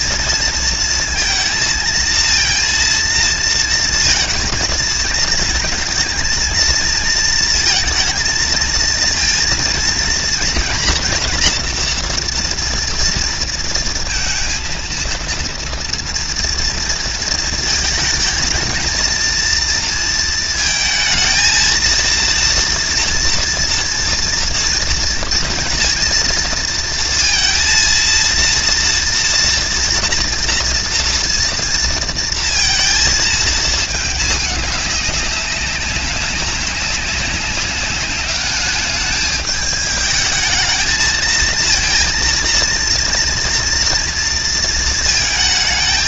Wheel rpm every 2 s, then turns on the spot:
230, 230, 230, 230, 230, 230, 240, 230, 230, 220, 230, 230, 230, 230, 230, 240, 230, 210, 200, 210, 220, 230, 230.
none